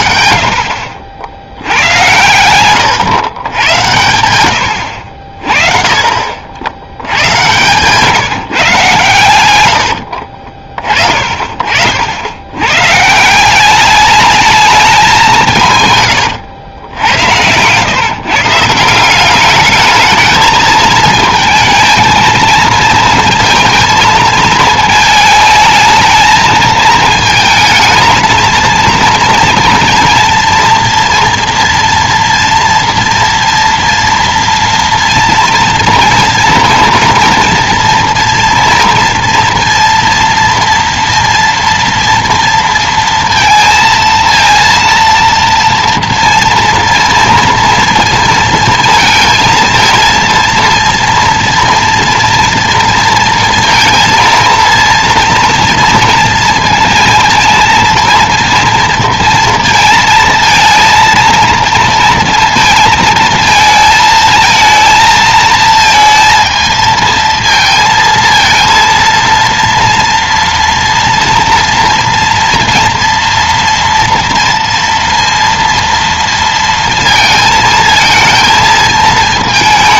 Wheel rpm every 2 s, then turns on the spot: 70, 110, 90, 70, 140, 40, 100, 210, 100, 160, 220, 230, 220, 220, 230, 230, 230, 230, 230, 230, 230, 230, 230, 230, 230, 230, 230, 230, 230, 230, 230, 230, 220, 220, 230, 230, 230, 230, 230, 220.
2-4